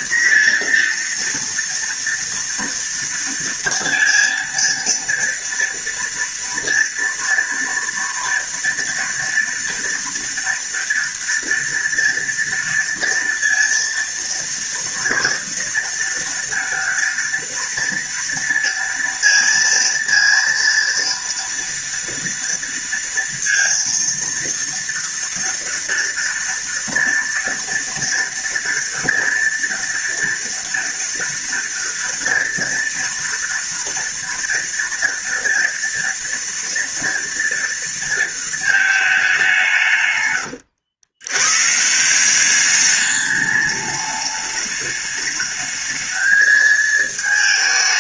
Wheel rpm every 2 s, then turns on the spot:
240, 230, 230, 230, 240, 230, 230, 230, 230, 230, 230, 230, 230, 230, 230, 230, 230, 230, 230, 220, 100, 200, 210, 220.
none